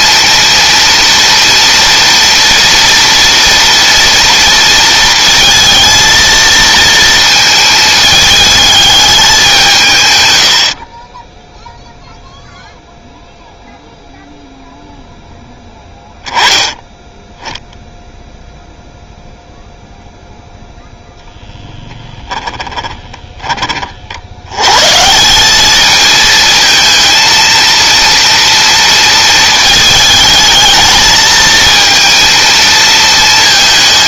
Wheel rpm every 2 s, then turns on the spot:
230, 230, 230, 230, 210, 40, 0, 0, 10, 0, 0, 20, 150, 230, 230, 220, 230.
22-24